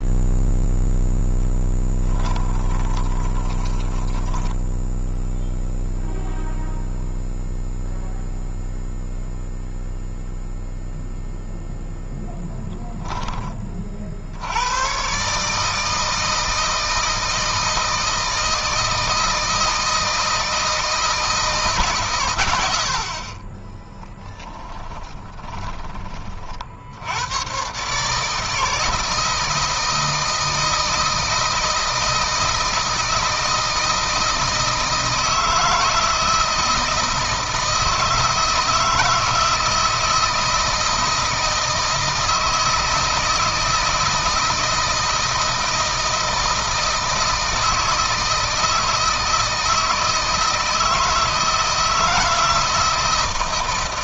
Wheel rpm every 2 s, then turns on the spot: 0, 20, 10, 0, 0, 0, 0, 100, 160, 160, 160, 80, 20, 40, 160, 160, 160, 160, 160, 160, 160, 160, 160, 160, 160, 160, 160.
2-6 24-26